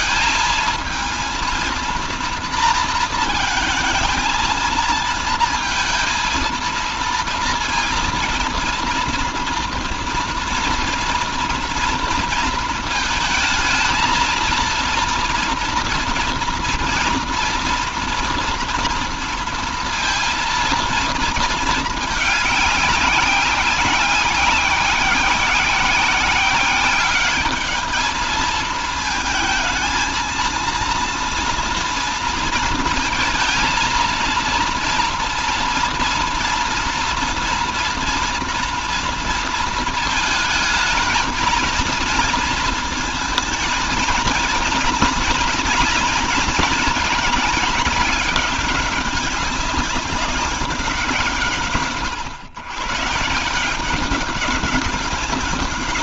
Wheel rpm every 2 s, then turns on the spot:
220, 220, 230, 230, 230, 230, 230, 230, 230, 230, 230, 200, 180, 190, 220, 230, 230, 240, 230, 230, 220, 230, 220, 210, 200, 190, 110, 200.
none